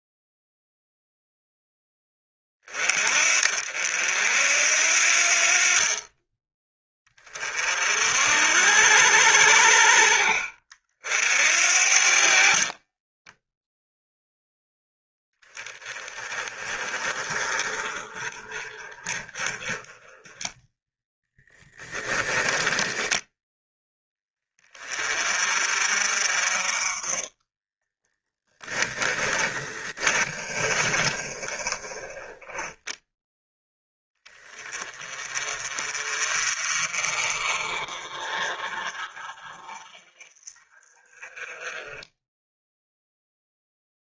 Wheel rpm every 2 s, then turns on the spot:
0, 30, 60, 20, 70, 50, 30, 0, 30, 30, 10, 10, 30, 30, 20, 30, 10, 30, 40, 40, 40, 0.
12-14 20-22 28-32